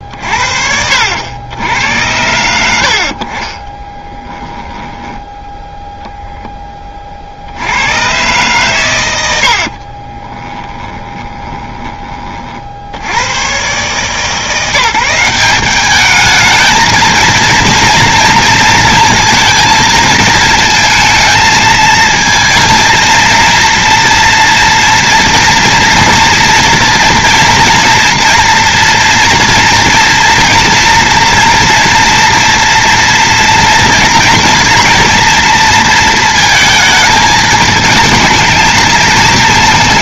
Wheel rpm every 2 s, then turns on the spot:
60, 70, 10, 20, 120, 20, 50, 170, 220, 230, 220, 230, 240, 230, 240, 230, 230, 230, 220, 220.
4-6 10-12